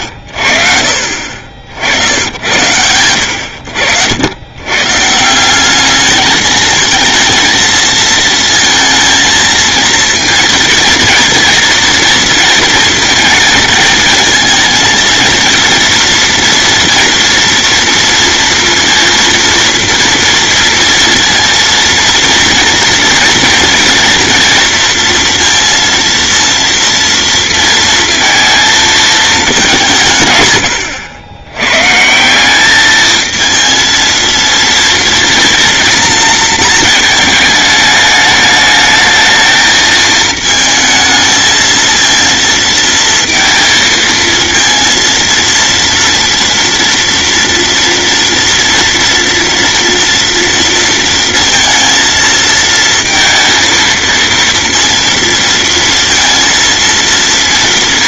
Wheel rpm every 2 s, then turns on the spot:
60, 90, 150, 220, 230, 230, 230, 220, 230, 230, 230, 240, 230, 230, 220, 100, 220, 230, 220, 220, 220, 230, 230, 230, 230, 230, 230, 230, 230.
none